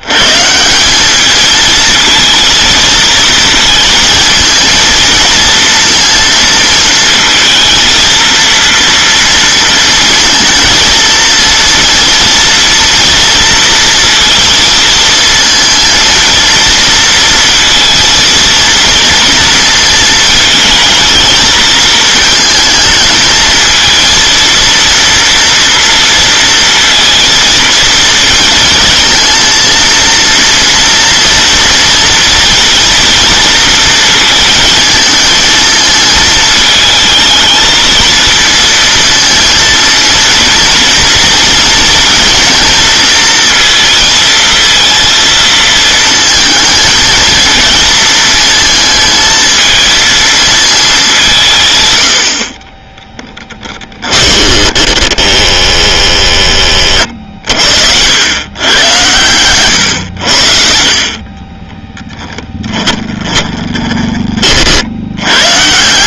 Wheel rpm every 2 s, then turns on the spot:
170, 230, 230, 230, 230, 220, 230, 230, 230, 230, 230, 220, 230, 230, 230, 230, 240, 230, 220, 230, 230, 230, 230, 220, 220, 220, 30, 20, 40, 110, 50, 20, 50.
54-56 62-64